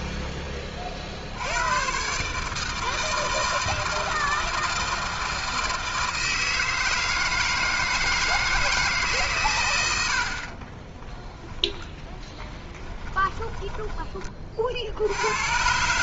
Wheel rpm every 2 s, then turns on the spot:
10, 140, 160, 160, 160, 60, 10, 20.
12-14